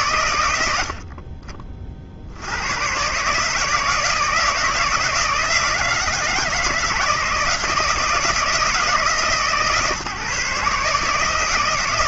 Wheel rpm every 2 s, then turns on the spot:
50, 150, 160, 160, 150, 160.
none